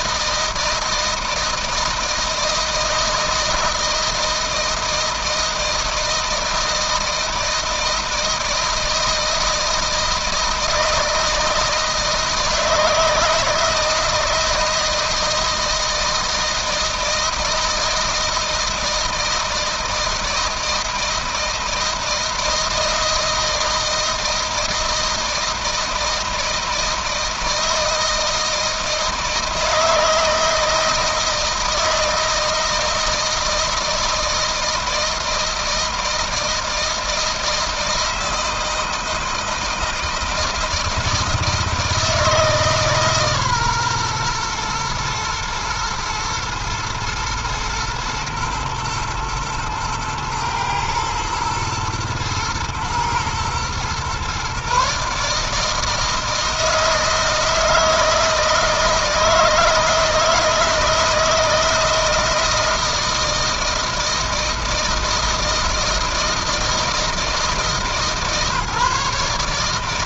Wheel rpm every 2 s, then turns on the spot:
160, 160, 160, 160, 160, 160, 160, 160, 160, 160, 160, 160, 160, 160, 160, 160, 160, 160, 160, 160, 160, 160, 120, 110, 110, 110, 110, 130, 160, 160, 160, 160, 160, 160, 150.
none